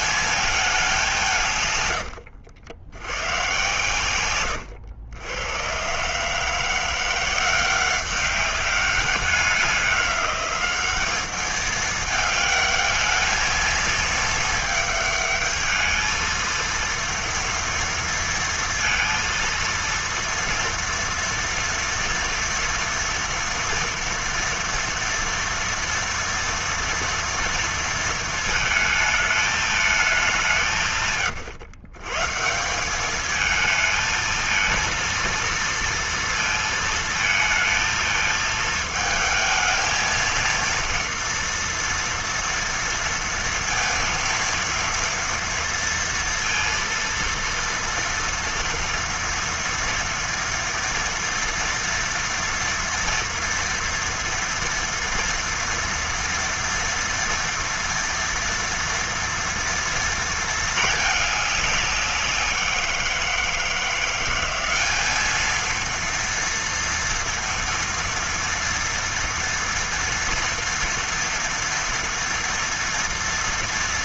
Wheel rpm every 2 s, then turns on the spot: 220, 90, 110, 150, 190, 200, 210, 220, 220, 230, 240, 230, 230, 230, 230, 190, 150, 220, 230, 220, 230, 230, 230, 230, 230, 230, 230, 230, 230, 230, 230, 190, 180, 230, 230, 230, 230.
2-4